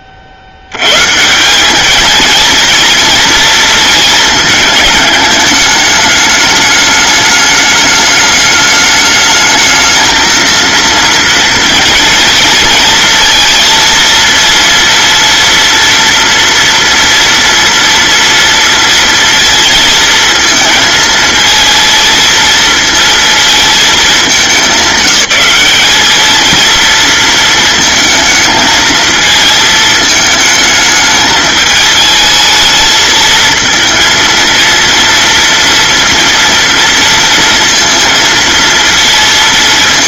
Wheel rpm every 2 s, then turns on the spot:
110, 230, 220, 210, 210, 230, 230, 230, 240, 230, 230, 230, 200, 230, 220, 210, 220, 230, 230, 230.
none